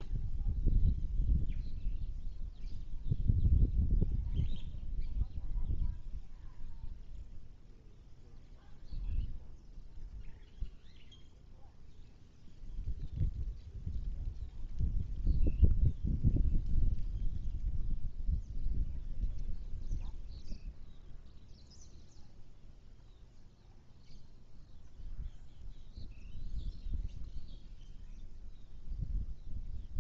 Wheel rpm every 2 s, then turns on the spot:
0, 0, 0, 0, 0, 0, 0, 0, 0, 0, 0, 0, 0, 0, 0.
none